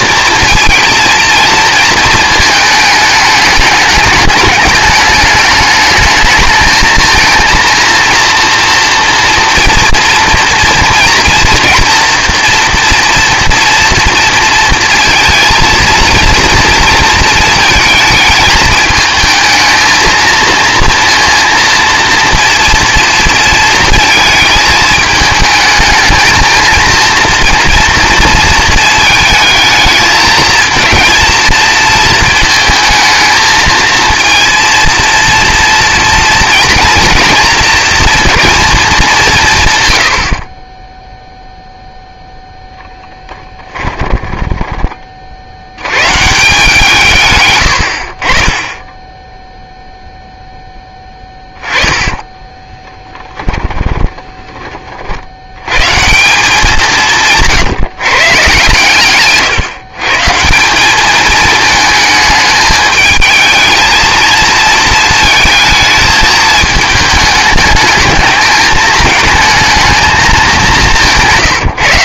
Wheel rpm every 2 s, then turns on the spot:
230, 220, 210, 220, 240, 230, 230, 230, 230, 220, 230, 230, 210, 230, 230, 230, 220, 230, 240, 220, 20, 10, 20, 160, 20, 10, 10, 30, 180, 130, 180, 210, 230, 220, 220, 200.
40-42 52-54